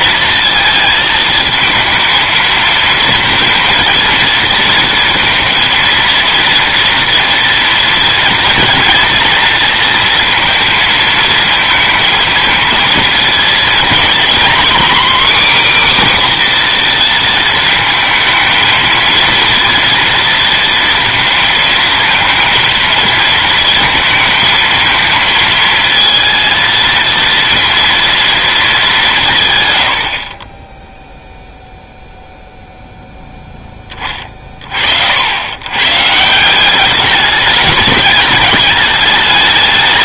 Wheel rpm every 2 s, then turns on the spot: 220, 230, 230, 230, 230, 230, 220, 260, 240, 230, 230, 230, 220, 230, 210, 10, 0, 50, 200, 210.
none